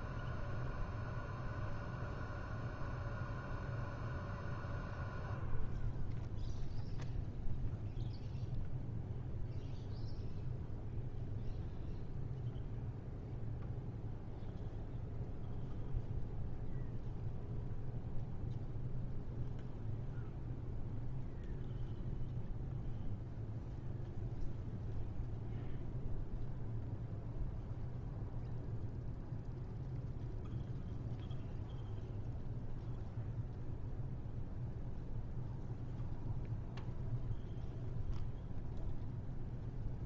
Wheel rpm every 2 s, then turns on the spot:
0, 0, 0, 0, 0, 0, 0, 0, 0, 0, 0, 0, 0, 0, 0, 0, 0, 0, 0, 0.
none